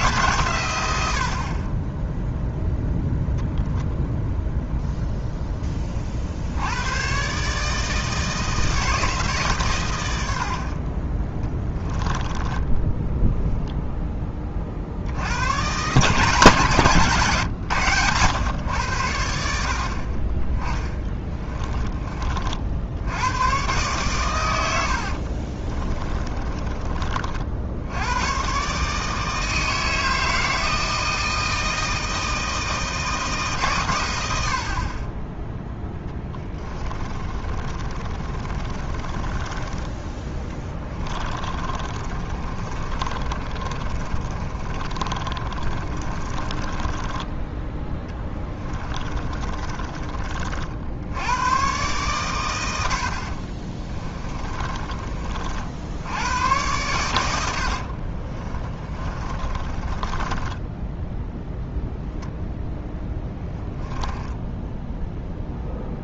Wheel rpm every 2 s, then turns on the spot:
120, 0, 0, 100, 160, 40, 20, 50, 150, 100, 10, 60, 80, 30, 140, 160, 160, 50, 30, 30, 20, 30, 30, 20, 30, 60, 90, 30, 100, 30, 10, 10, 10.
20-22 24-26 36-50 54-56 58-62 64-66